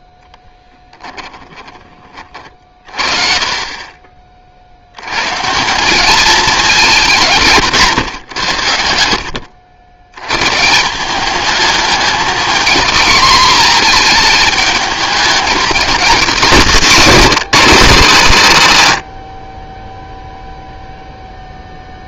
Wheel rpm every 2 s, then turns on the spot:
10, 40, 90, 180, 80, 170, 230, 210, 220, 90, 0.
0-2